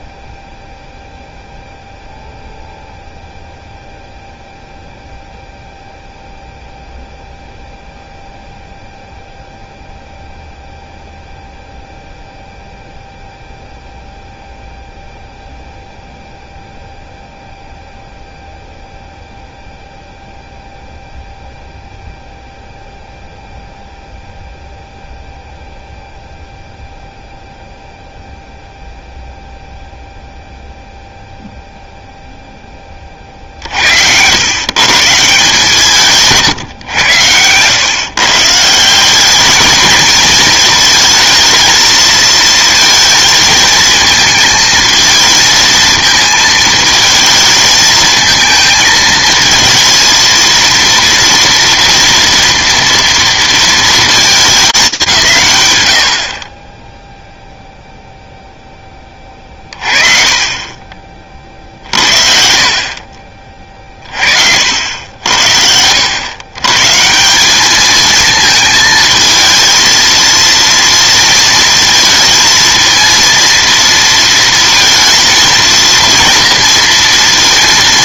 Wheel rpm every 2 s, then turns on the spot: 0, 0, 0, 0, 0, 0, 0, 0, 0, 0, 0, 0, 0, 0, 0, 0, 10, 130, 130, 160, 220, 230, 220, 220, 220, 230, 230, 210, 20, 10, 30, 50, 70, 150, 220, 230, 230, 230, 230.
none